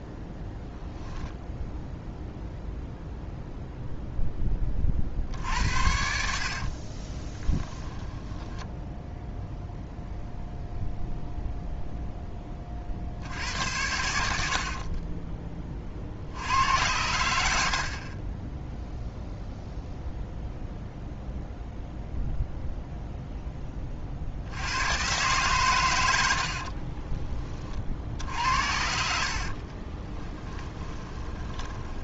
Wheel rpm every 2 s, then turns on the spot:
0, 0, 30, 50, 10, 0, 30, 50, 90, 10, 0, 0, 100, 50, 60, 10.
6-10 14-16 26-28 30-32